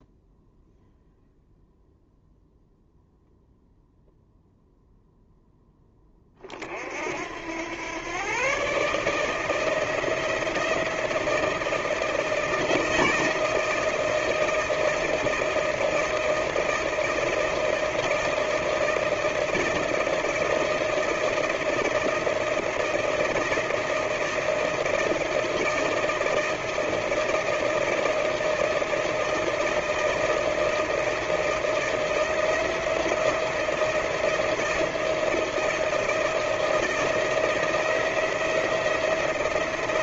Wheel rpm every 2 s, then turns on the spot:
0, 0, 0, 60, 140, 170, 160, 160, 160, 160, 160, 160, 160, 160, 160, 160, 170, 160, 160, 170.
none